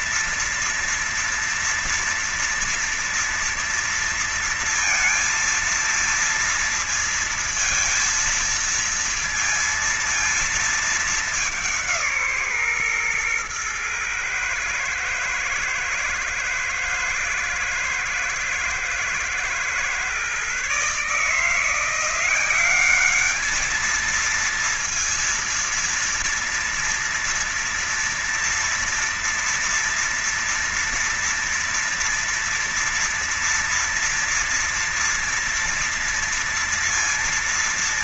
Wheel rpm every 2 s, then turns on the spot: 240, 230, 230, 230, 230, 230, 160, 110, 110, 110, 120, 180, 220, 230, 230, 230, 230, 230, 230.
none